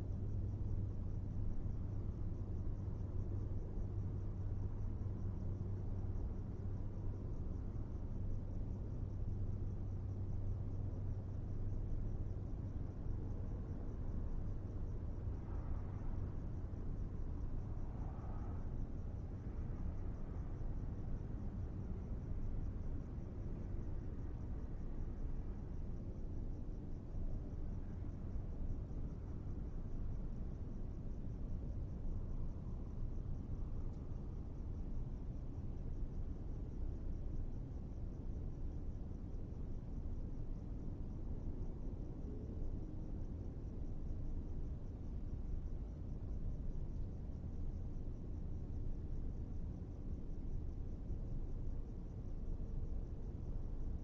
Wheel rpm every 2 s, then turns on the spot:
0, 0, 0, 0, 0, 0, 0, 0, 0, 0, 0, 0, 0, 0, 0, 0, 0, 0, 0, 0, 0, 0, 0, 0, 0, 0, 0.
none